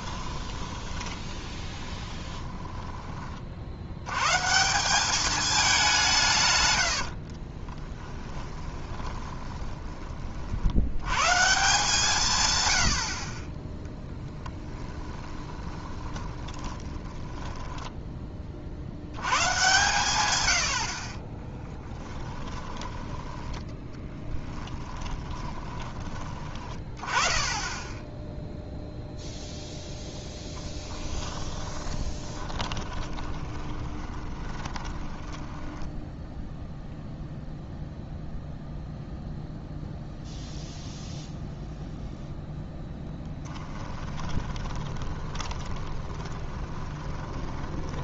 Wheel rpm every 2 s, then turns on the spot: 10, 10, 180, 110, 20, 80, 100, 10, 30, 60, 70, 20, 10, 20, 0, 20, 20, 20, 0, 0, 0, 0, 20, 20.
0-4 8-10 14-18 22-26 30-36 44-48